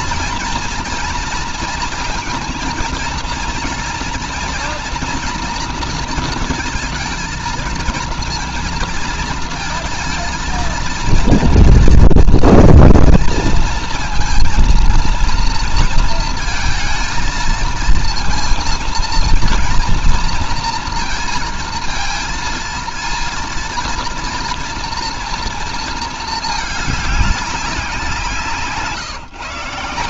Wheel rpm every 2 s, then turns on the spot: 230, 230, 230, 220, 230, 230, 230, 230, 220, 230, 230, 230, 240, 220, 150.
none